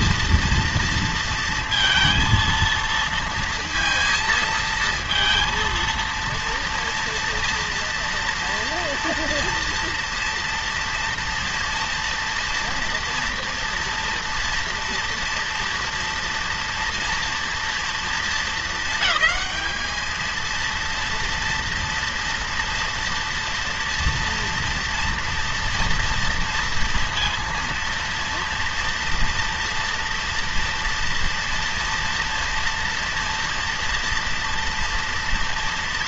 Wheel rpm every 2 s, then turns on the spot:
230, 230, 230, 230, 230, 230, 230, 230, 240, 220, 230, 230, 230, 230, 230, 230, 230, 230.
none